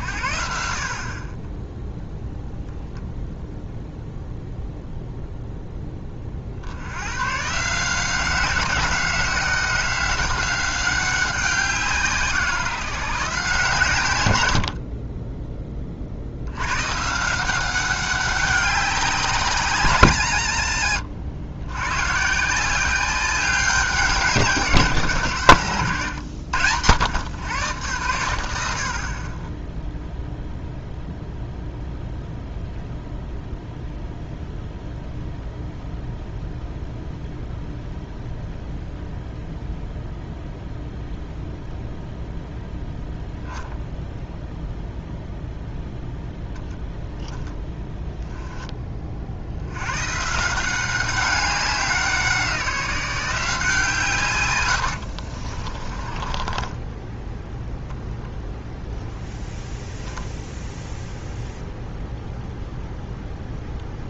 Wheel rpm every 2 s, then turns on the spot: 50, 0, 0, 80, 180, 190, 170, 40, 110, 190, 80, 180, 150, 90, 70, 0, 0, 0, 0, 0, 0, 0, 0, 0, 20, 180, 180, 100, 10, 0, 0, 0.
54-58